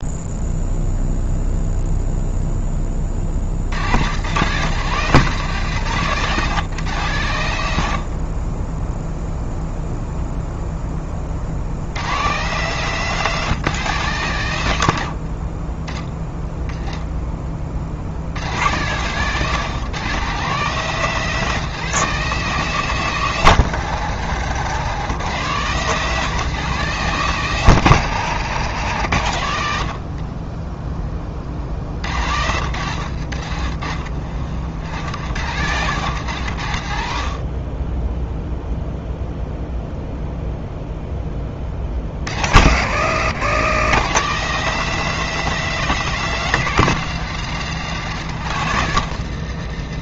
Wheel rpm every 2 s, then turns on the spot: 0, 10, 130, 160, 20, 0, 140, 110, 10, 90, 160, 180, 140, 170, 140, 30, 80, 60, 110, 0, 0, 70, 160, 170, 120.
none